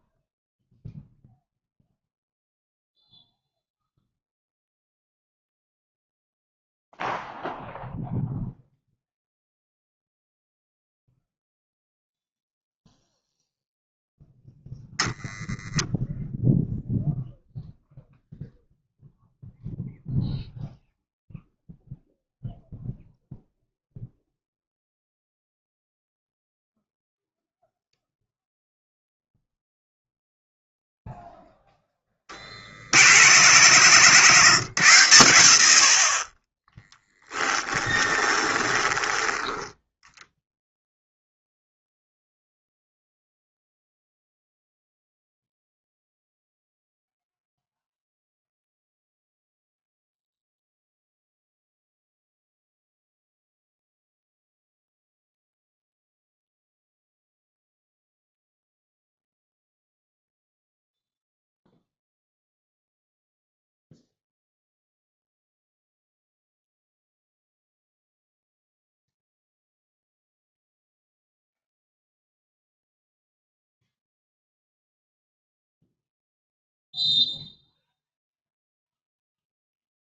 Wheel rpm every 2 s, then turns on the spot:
0, 0, 0, 0, 0, 0, 0, 0, 0, 0, 0, 0, 0, 0, 0, 0, 70, 120, 10, 10, 0, 0, 0, 0, 0, 0, 0, 0, 0, 0, 0, 0, 0, 0, 0, 0, 0, 0, 0, 0.
36-40